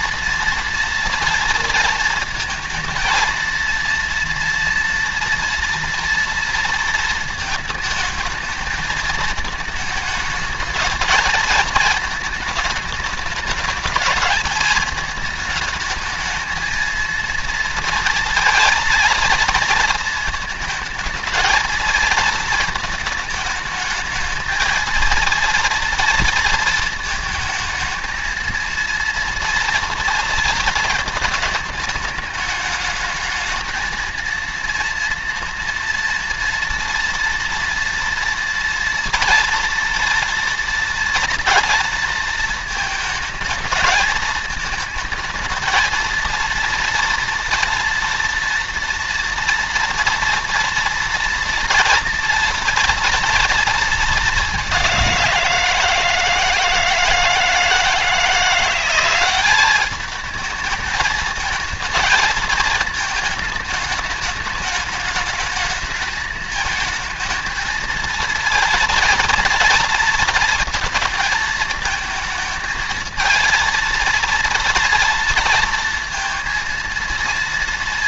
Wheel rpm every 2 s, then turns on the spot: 230, 230, 230, 230, 220, 220, 210, 220, 230, 230, 220, 220, 220, 230, 230, 230, 210, 230, 230, 230, 230, 220, 220, 230, 230, 230, 240, 200, 160, 180, 220, 220, 210, 220, 230, 230, 220, 230, 230.
none